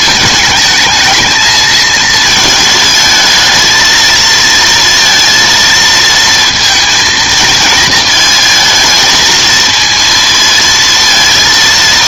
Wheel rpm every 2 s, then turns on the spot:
210, 220, 230, 230, 220, 230.
none